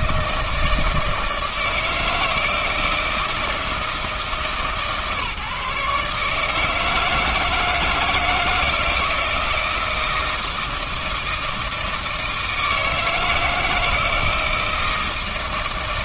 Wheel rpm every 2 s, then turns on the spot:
160, 160, 150, 150, 160, 160, 160, 160.
none